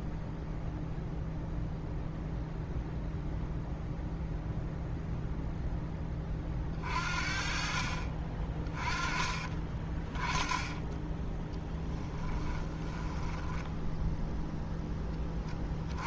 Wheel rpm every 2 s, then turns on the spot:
0, 0, 0, 40, 20, 10, 10, 10.
12-14